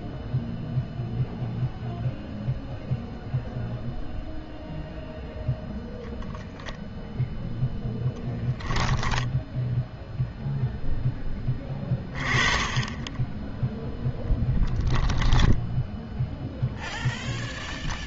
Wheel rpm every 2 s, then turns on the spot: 0, 0, 0, 0, 10, 0, 20, 10, 0.
8-10 14-16